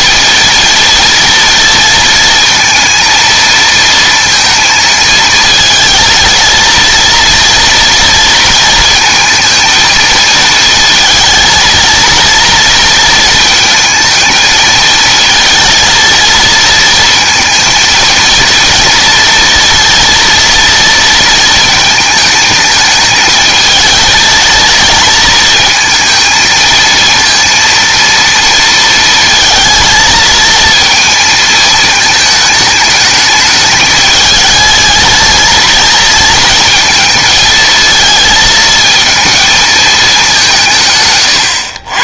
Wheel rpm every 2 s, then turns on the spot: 230, 230, 230, 230, 230, 230, 230, 220, 220, 230, 230, 220, 220, 220, 230, 230, 210, 210, 230, 220, 170.
none